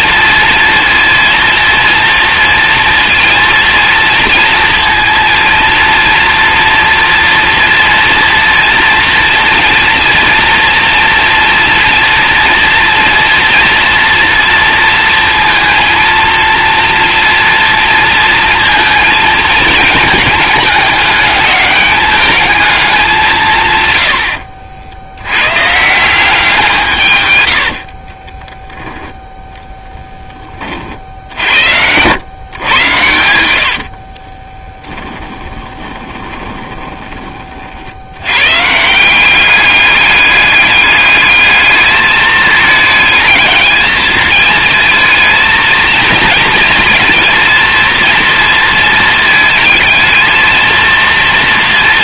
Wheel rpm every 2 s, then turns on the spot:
230, 230, 230, 230, 230, 230, 240, 230, 230, 230, 210, 210, 70, 170, 10, 40, 110, 20, 20, 150, 210, 220, 220, 230, 220, 230.
34-38